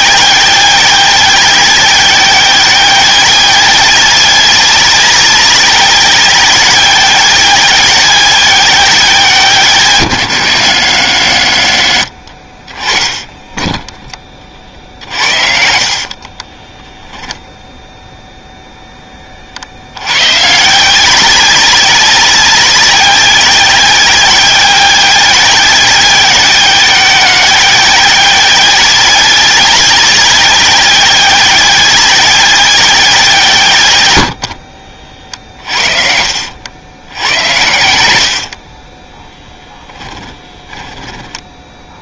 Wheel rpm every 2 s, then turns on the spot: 190, 190, 190, 190, 180, 100, 30, 40, 10, 0, 130, 190, 190, 190, 190, 190, 190, 60, 70, 50, 20.
14-18 34-36 38-42